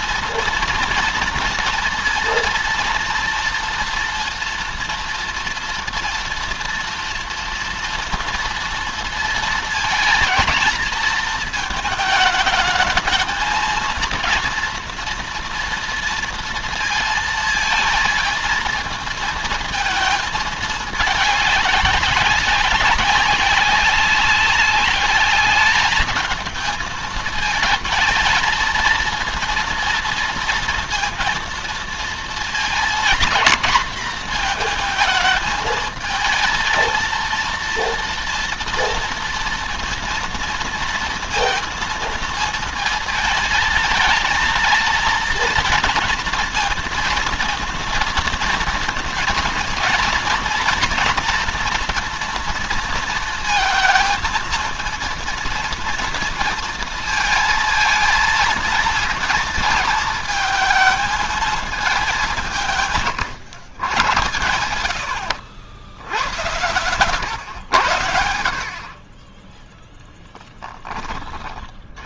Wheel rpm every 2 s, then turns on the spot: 230, 230, 230, 230, 230, 230, 220, 240, 230, 220, 210, 190, 200, 220, 230, 230, 230, 230, 220, 230, 230, 220, 230, 230, 230, 240, 230, 230, 230, 230, 220, 170, 90, 100, 60, 10.
none